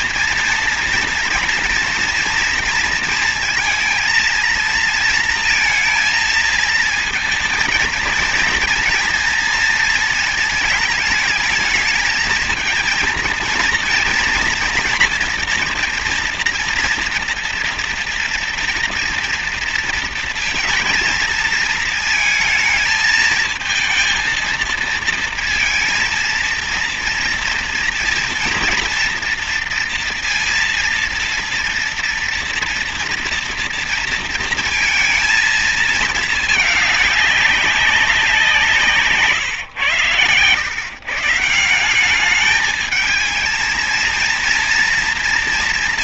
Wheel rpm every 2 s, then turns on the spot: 230, 230, 230, 230, 230, 230, 220, 230, 230, 240, 230, 230, 230, 230, 230, 230, 230, 230, 220, 180, 120, 210, 230.
none